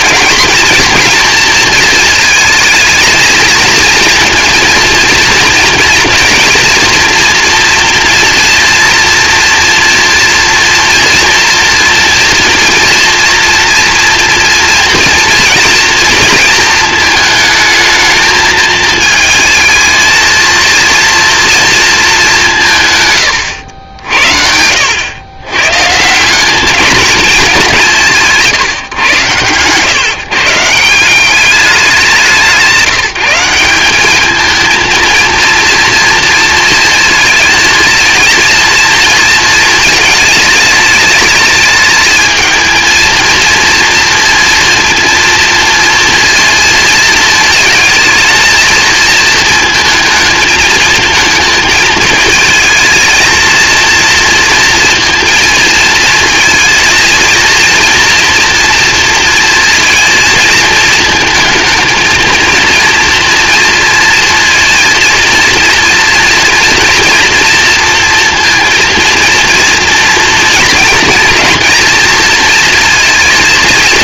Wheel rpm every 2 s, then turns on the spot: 240, 220, 230, 240, 230, 230, 230, 230, 220, 220, 220, 160, 70, 200, 160, 150, 190, 230, 230, 230, 220, 220, 230, 230, 220, 220, 220, 230, 230, 230, 230, 230, 230, 230, 230, 230, 230.
none